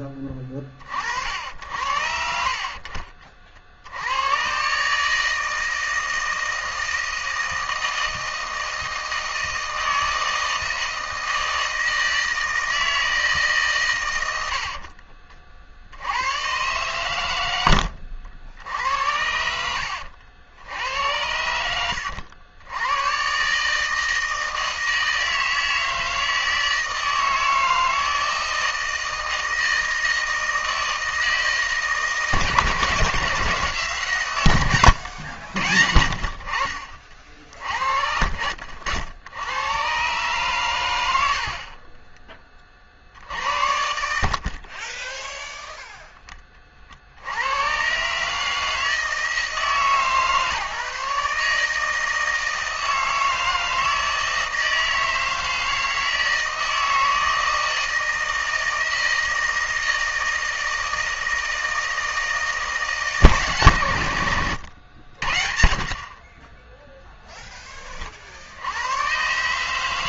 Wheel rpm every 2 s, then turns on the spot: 30, 50, 120, 160, 160, 160, 160, 60, 120, 70, 80, 90, 160, 160, 160, 160, 160, 110, 60, 70, 120, 30, 40, 30, 160, 150, 160, 160, 160, 160, 160, 160, 80, 10, 80.
14-16 44-46